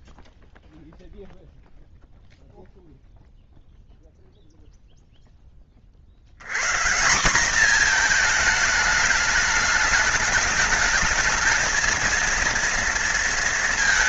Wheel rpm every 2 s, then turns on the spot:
0, 0, 0, 130, 220, 210, 230.
none